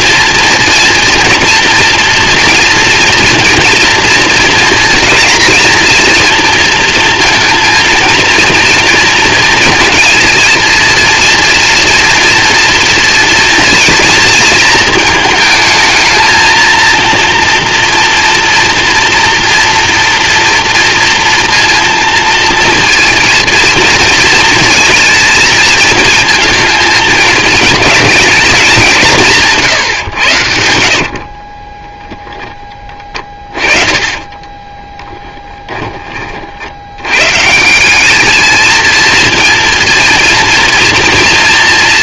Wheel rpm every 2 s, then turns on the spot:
230, 230, 230, 230, 230, 230, 230, 230, 230, 230, 230, 230, 220, 220, 200, 70, 20, 20, 80, 220, 230.
32-36